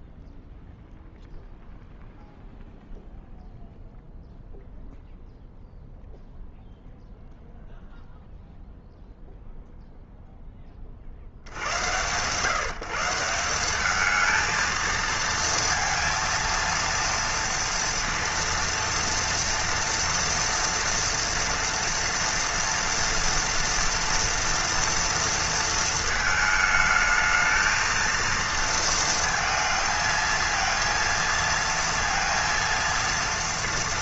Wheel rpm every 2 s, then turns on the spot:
0, 0, 0, 0, 0, 20, 150, 220, 230, 230, 230, 230, 230, 220, 230, 230, 230.
none